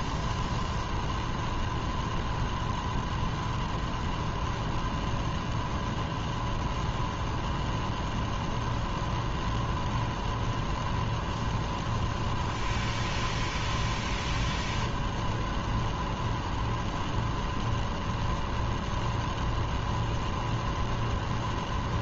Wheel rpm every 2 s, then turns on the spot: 0, 0, 0, 0, 0, 0, 0, 0, 0, 0, 0.
none